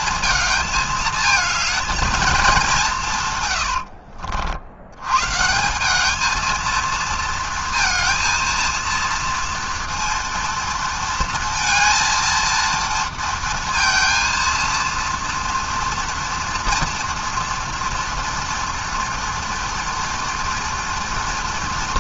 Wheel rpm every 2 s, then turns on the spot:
220, 190, 70, 220, 230, 230, 230, 230, 230, 240, 230.
none